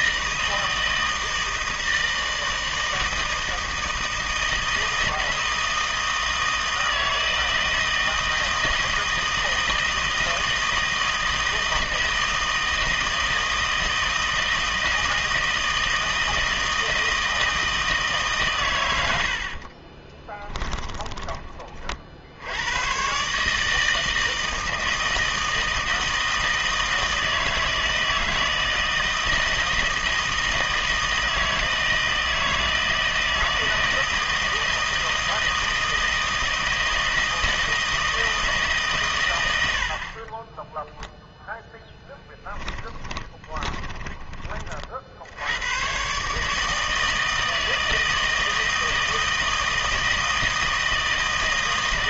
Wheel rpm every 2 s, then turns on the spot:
160, 160, 160, 160, 160, 160, 160, 160, 160, 120, 10, 90, 160, 160, 160, 160, 160, 160, 160, 160, 10, 10, 40, 150, 160, 160.
20-22 40-44